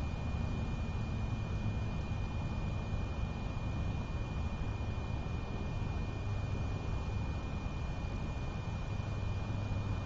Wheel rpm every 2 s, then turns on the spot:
0, 0, 0, 0, 0.
none